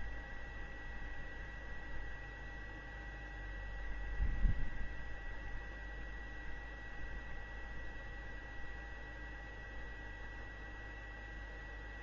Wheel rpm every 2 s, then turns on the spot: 0, 0, 0, 0, 0, 0.
none